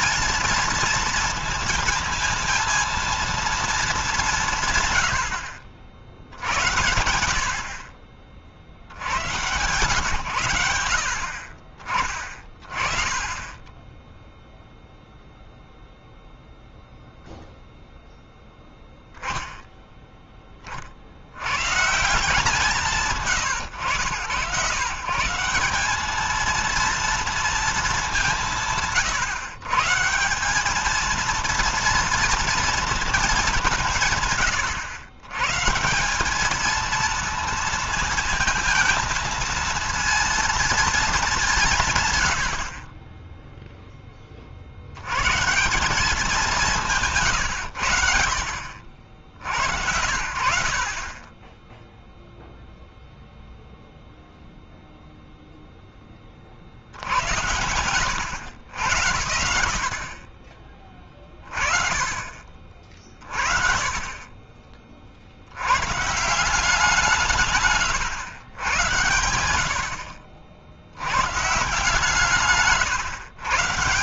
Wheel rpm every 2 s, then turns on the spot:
230, 230, 160, 70, 50, 100, 40, 0, 0, 0, 20, 160, 100, 220, 180, 200, 230, 130, 210, 220, 230, 70, 50, 190, 60, 60, 0, 0, 40, 70, 30, 30, 30, 170, 100, 60, 150.
72-74